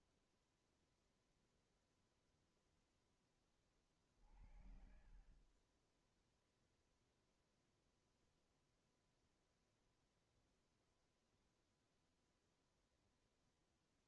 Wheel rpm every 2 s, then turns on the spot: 0, 10, 60, 0, 0, 0, 0.
none